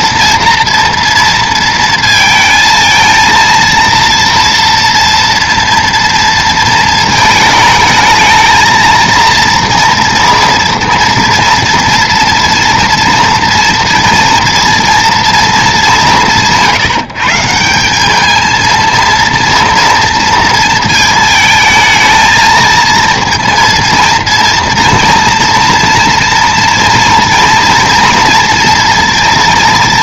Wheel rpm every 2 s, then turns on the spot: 230, 230, 230, 230, 220, 230, 230, 230, 170, 220, 220, 220, 230, 230, 230.
none